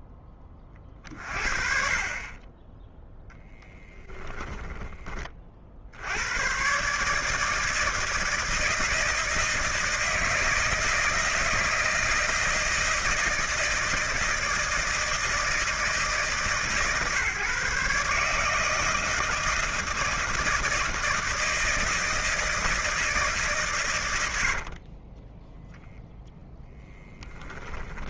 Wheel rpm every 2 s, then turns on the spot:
20, 10, 20, 130, 160, 160, 160, 160, 140, 160, 160, 160, 50, 0.
24-26